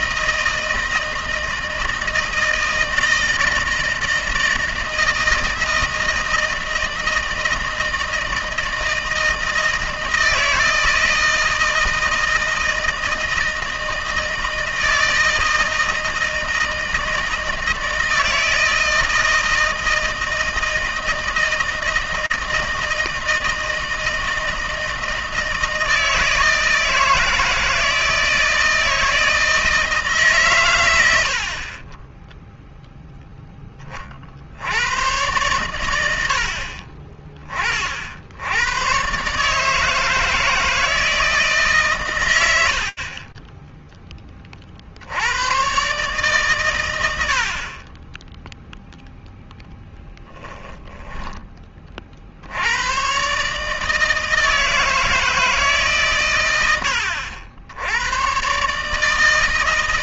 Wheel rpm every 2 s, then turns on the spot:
160, 160, 160, 160, 160, 160, 170, 160, 160, 160, 160, 160, 160, 160, 160, 110, 0, 100, 40, 130, 160, 40, 90, 90, 0, 10, 120, 160, 80, 150.
42-44